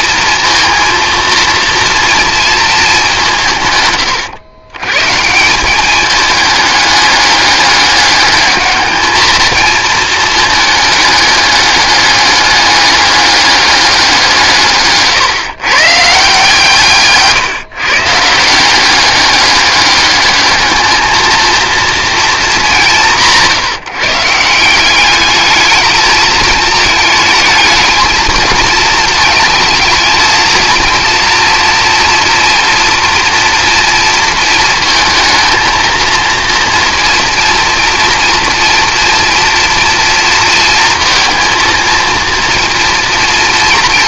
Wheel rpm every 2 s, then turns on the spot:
230, 210, 140, 210, 210, 210, 200, 150, 150, 190, 220, 170, 180, 220, 220, 230, 240, 230, 230, 230, 230, 230.
none